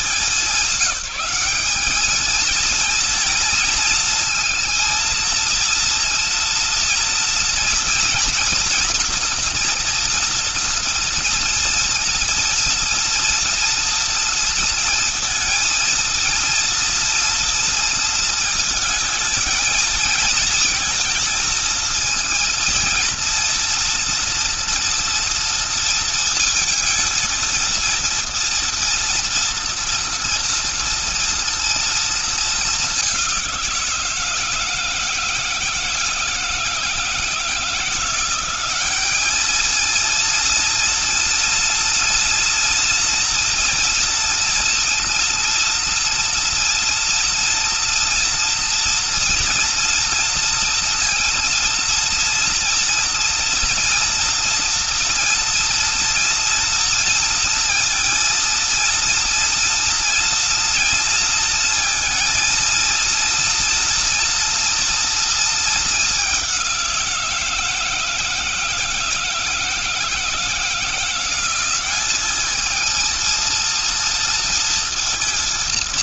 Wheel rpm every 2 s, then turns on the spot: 190, 220, 230, 230, 240, 240, 240, 230, 230, 220, 230, 230, 230, 230, 230, 230, 190, 160, 160, 210, 230, 230, 230, 230, 240, 230, 230, 230, 230, 230, 230, 230, 230, 170, 160, 180, 230, 230.
none